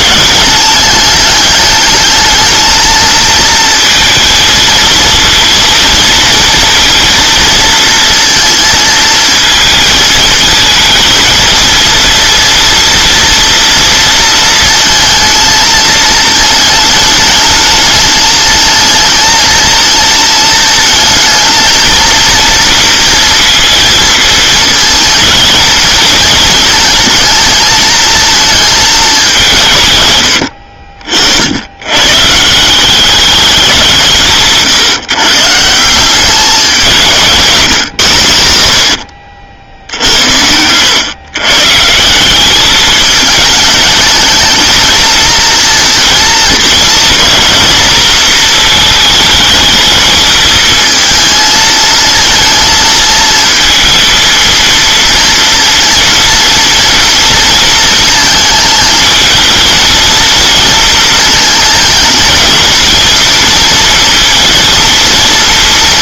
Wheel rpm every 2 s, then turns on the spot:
210, 220, 230, 230, 230, 230, 230, 230, 210, 220, 220, 230, 220, 220, 210, 60, 180, 150, 190, 80, 100, 210, 220, 230, 220, 220, 220, 230, 230, 220, 230, 220, 230.
30-32